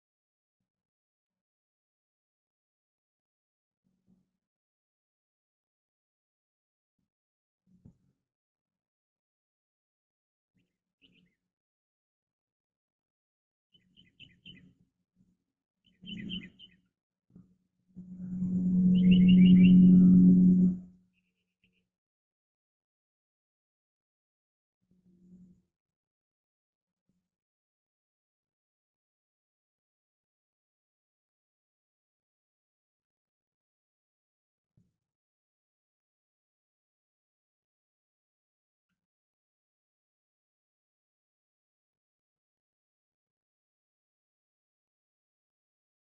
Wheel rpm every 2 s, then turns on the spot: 0, 0, 0, 0, 0, 0, 0, 0, 0, 0, 0, 0, 0, 0, 0, 0, 0, 0, 0, 0, 0, 0, 0.
none